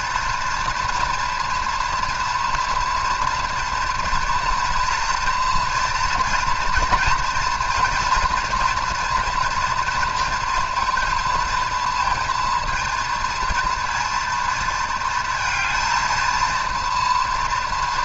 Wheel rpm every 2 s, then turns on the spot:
230, 230, 230, 240, 230, 230, 230, 220, 230.
none